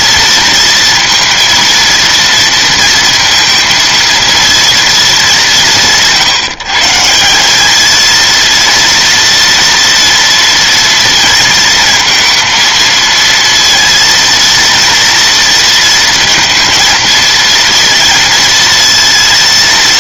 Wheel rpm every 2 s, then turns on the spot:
230, 230, 220, 150, 230, 230, 230, 230, 230, 230.
none